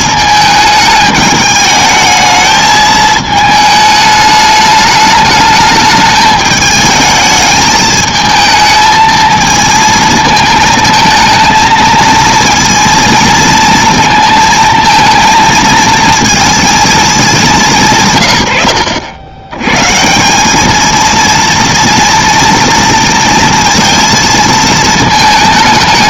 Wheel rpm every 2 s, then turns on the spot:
220, 220, 210, 210, 220, 220, 230, 220, 230, 90, 210, 230, 220.
none